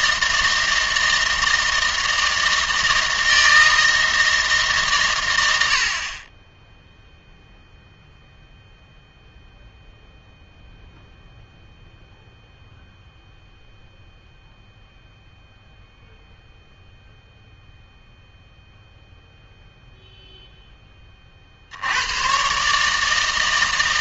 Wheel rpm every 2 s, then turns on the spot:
160, 160, 150, 10, 0, 0, 0, 0, 0, 0, 10, 140.
none